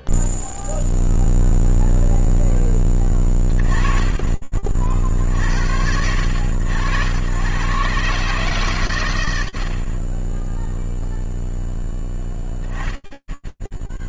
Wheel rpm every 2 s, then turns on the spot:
0, 0, 30, 70, 140, 30, 10.
none